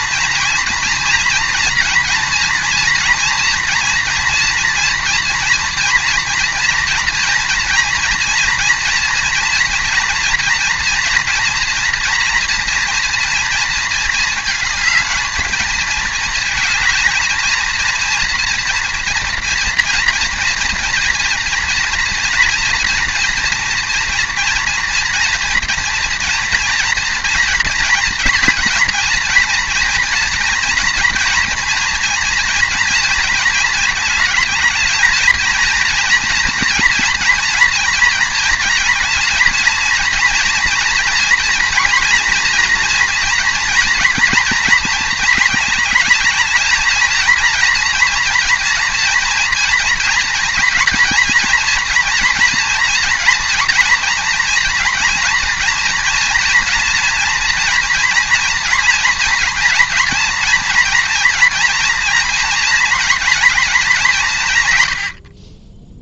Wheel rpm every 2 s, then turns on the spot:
230, 230, 230, 230, 230, 240, 230, 220, 220, 230, 240, 230, 230, 230, 230, 230, 240, 210, 230, 230, 230, 230, 230, 220, 230, 240, 240, 230, 240, 230, 230, 230, 140.
none